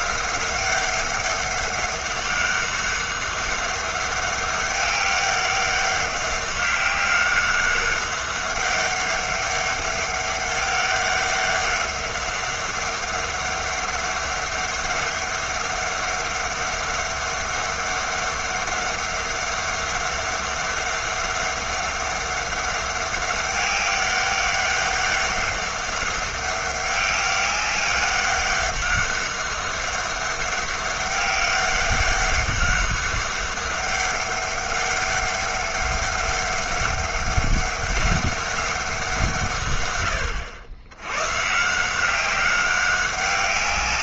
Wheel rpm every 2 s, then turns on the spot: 190, 200, 200, 190, 200, 200, 200, 200, 200, 200, 200, 200, 200, 200, 200, 200, 200, 200, 200, 200, 90, 190.
none